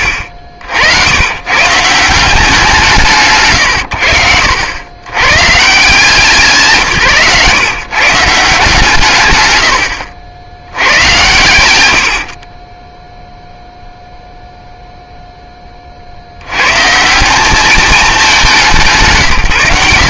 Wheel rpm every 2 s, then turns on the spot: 70, 200, 80, 140, 160, 90, 10, 0, 120, 160.
none